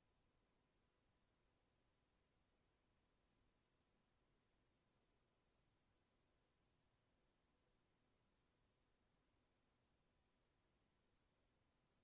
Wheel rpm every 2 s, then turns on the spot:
0, 0, 0, 0, 0, 0.
none